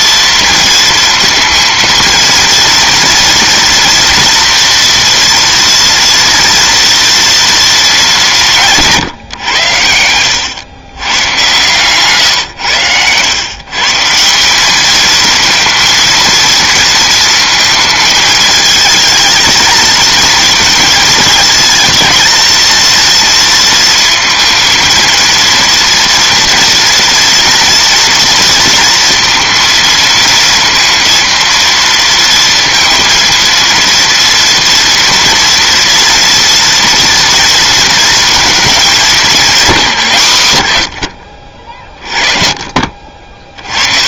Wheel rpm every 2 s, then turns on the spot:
230, 230, 240, 230, 160, 100, 110, 200, 230, 220, 230, 230, 230, 230, 230, 230, 230, 230, 230, 220, 110, 40.
none